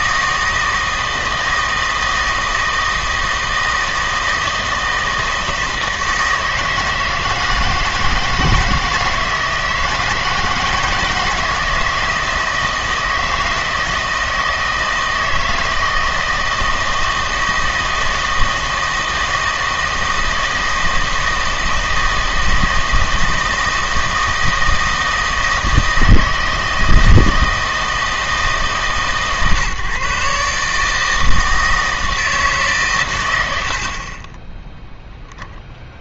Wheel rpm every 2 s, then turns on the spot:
160, 160, 160, 160, 160, 160, 160, 160, 160, 160, 160, 160, 160, 160, 150, 150, 140, 10.
34-36